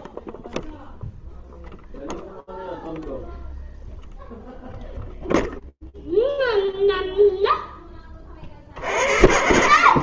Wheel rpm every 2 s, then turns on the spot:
0, 0, 0, 0, 40.
none